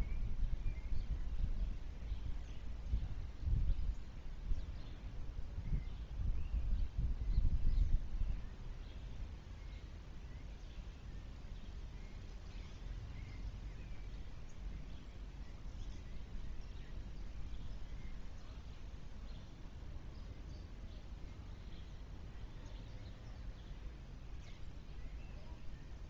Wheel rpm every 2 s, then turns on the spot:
0, 0, 0, 0, 0, 0, 0, 0, 0, 0, 0, 0, 0.
none